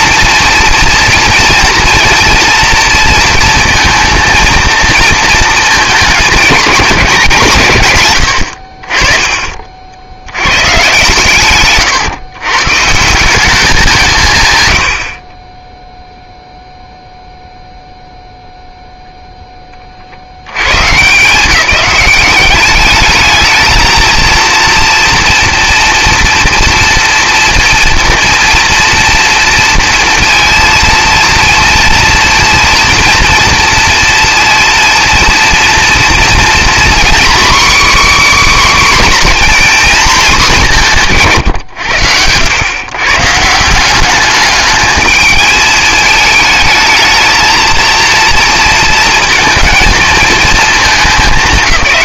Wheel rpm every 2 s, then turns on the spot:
240, 230, 230, 190, 60, 120, 130, 120, 0, 0, 100, 200, 230, 230, 230, 230, 230, 230, 240, 280, 190, 110, 210, 220, 230, 220.
none